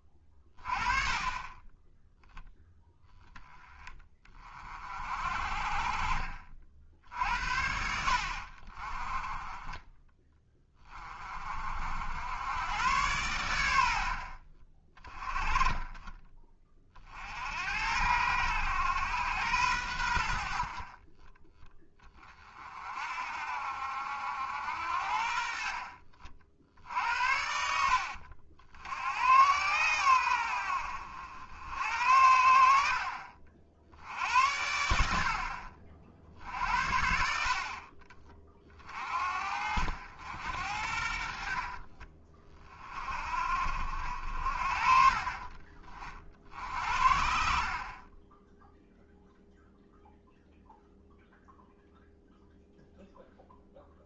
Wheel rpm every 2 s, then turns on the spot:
30, 0, 40, 50, 40, 20, 100, 40, 30, 110, 50, 40, 70, 60, 70, 70, 60, 80, 60, 30, 70, 30, 50, 60, 0, 0, 0.
none